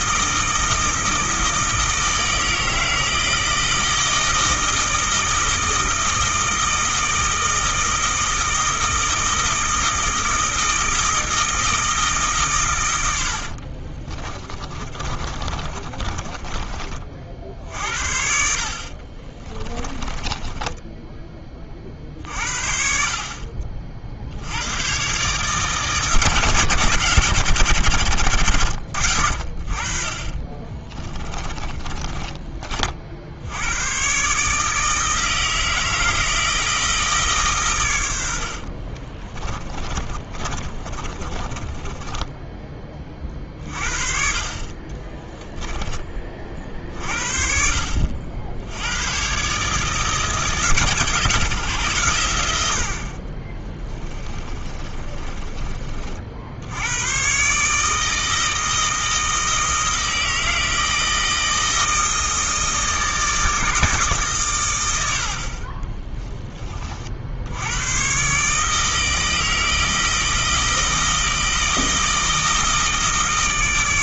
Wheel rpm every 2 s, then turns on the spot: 160, 160, 160, 160, 160, 160, 120, 30, 30, 50, 10, 60, 100, 160, 60, 20, 40, 160, 160, 50, 30, 20, 40, 50, 90, 160, 70, 20, 90, 160, 160, 160, 110, 30, 150, 160, 160.
14-22 30-32 38-42 44-46 54-56